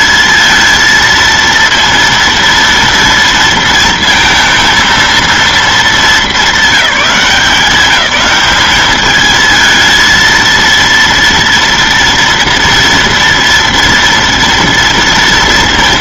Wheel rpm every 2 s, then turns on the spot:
230, 230, 230, 210, 210, 230, 230, 240.
none